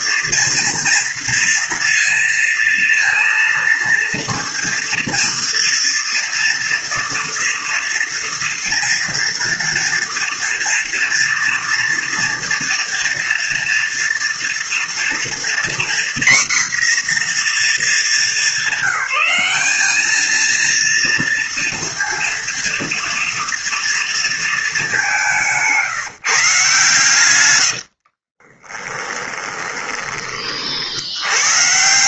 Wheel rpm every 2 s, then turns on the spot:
230, 230, 230, 230, 230, 230, 230, 230, 250, 210, 230, 230, 220, 150, 20, 40.
28-30